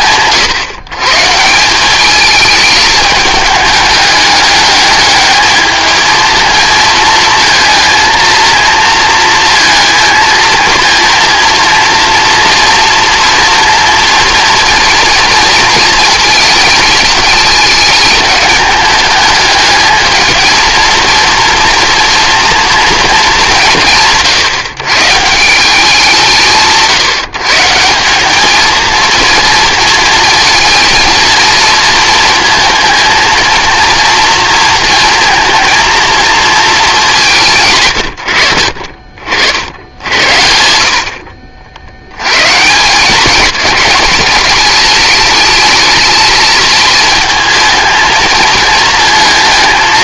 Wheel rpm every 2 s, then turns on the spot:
140, 210, 220, 230, 230, 230, 230, 230, 220, 210, 230, 160, 140, 140, 230, 230, 230, 230, 220, 60, 70, 180, 220, 220, 230.
none